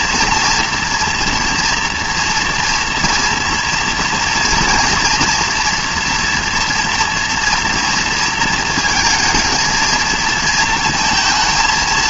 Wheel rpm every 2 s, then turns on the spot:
240, 240, 230, 230, 230, 220.
none